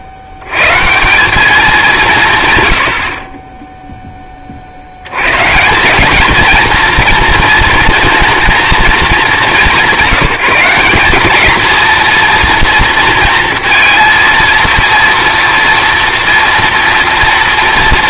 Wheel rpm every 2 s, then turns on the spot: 50, 130, 50, 230, 220, 170, 230, 230, 230.
none